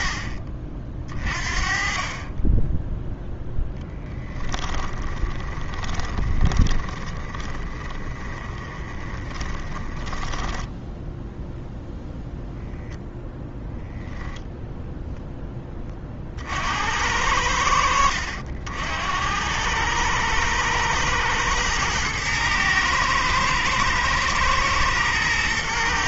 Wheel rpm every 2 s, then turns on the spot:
40, 10, 20, 20, 20, 10, 0, 10, 70, 70, 100, 110, 110.
4-12